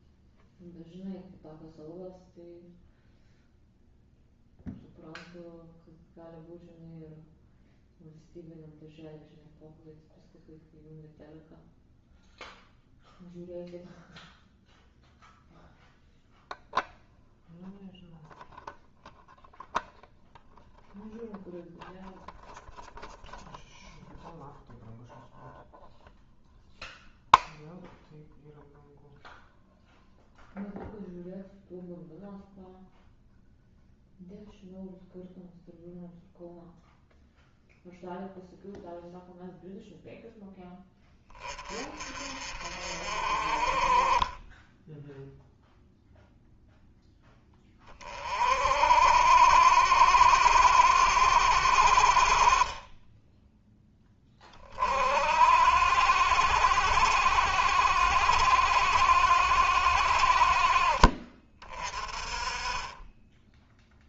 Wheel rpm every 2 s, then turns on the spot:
0, 0, 0, 0, 0, 0, 0, 0, 0, 0, 0, 0, 0, 0, 0, 0, 0, 0, 0, 0, 10, 40, 10, 0, 50, 70, 30, 30, 70, 60, 50, 20.
none